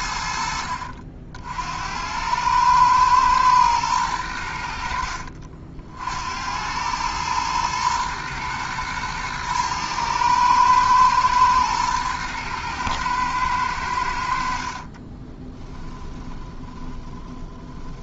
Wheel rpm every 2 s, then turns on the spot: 60, 110, 60, 100, 110, 110, 110, 40, 30.
14-18